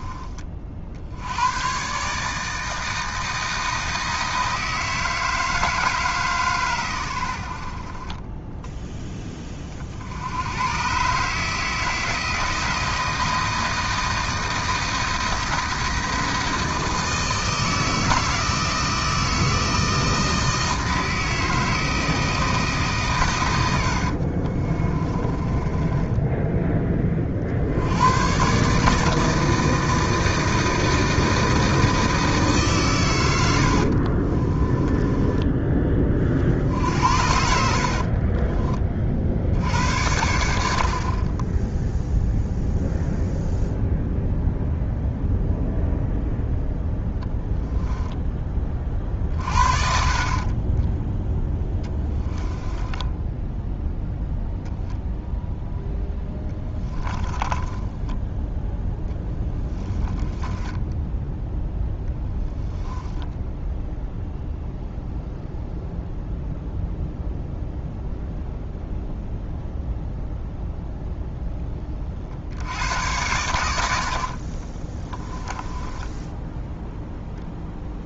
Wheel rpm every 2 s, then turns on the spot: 60, 160, 160, 110, 10, 120, 170, 160, 160, 160, 160, 150, 30, 20, 150, 160, 130, 20, 60, 40, 60, 0, 0, 10, 30, 10, 10, 0, 10, 10, 10, 0, 0, 0, 0, 0, 100, 30, 0.
24-26 34-38 50-54 56-58 60-62 74-76